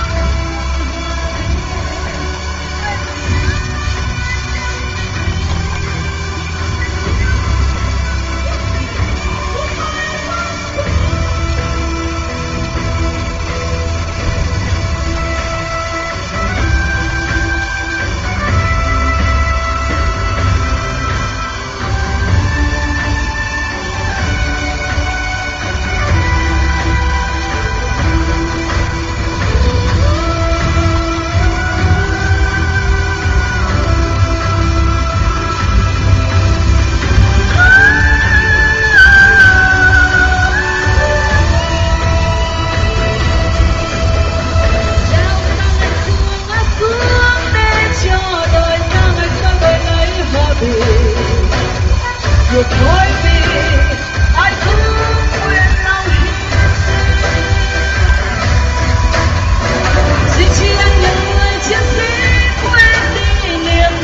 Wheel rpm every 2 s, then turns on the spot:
150, 150, 160, 150, 150, 150, 150, 160, 150, 150, 150, 150, 160, 160, 160, 150, 150, 160, 160, 160, 160, 160, 160, 160, 160, 160, 160, 160, 160, 160, 150, 150.
none